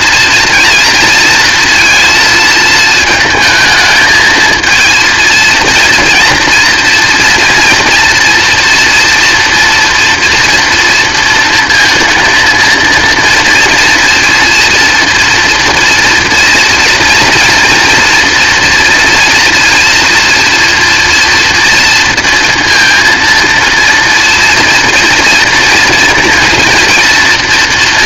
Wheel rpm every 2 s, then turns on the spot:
230, 220, 230, 230, 230, 230, 230, 230, 230, 230, 240, 230, 230, 230.
none